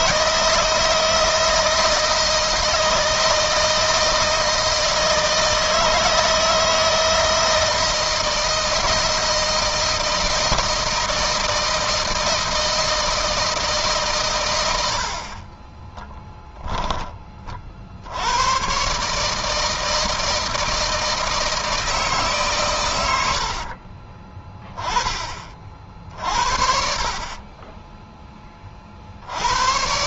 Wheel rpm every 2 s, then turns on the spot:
160, 160, 160, 160, 160, 170, 160, 60, 20, 140, 160, 100, 20, 40, 60.
22-24 26-28